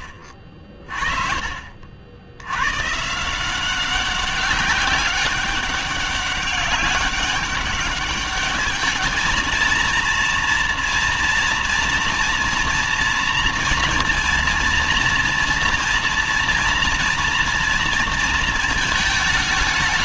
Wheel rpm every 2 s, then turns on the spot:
60, 110, 200, 200, 210, 230, 240, 230, 230, 220.
none